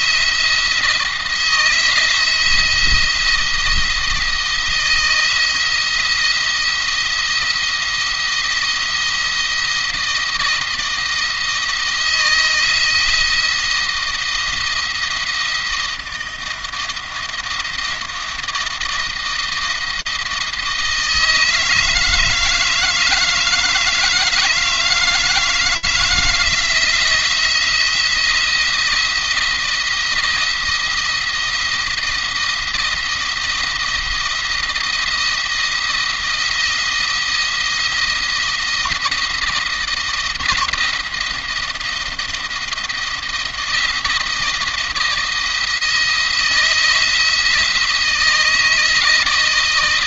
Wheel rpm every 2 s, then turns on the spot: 170, 170, 170, 170, 170, 160, 160, 170, 170, 170, 160, 160, 160, 170, 170, 170, 170, 170, 170, 170, 170, 170, 160, 170, 160.
none